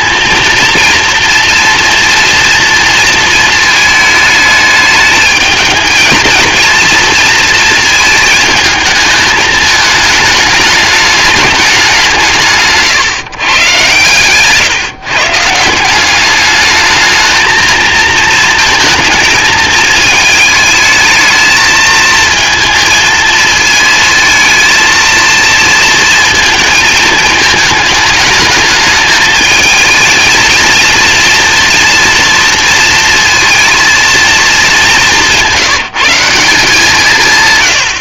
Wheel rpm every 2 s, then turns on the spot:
230, 230, 210, 230, 220, 210, 150, 140, 210, 230, 220, 220, 220, 220, 210, 230, 230, 200, 170.
none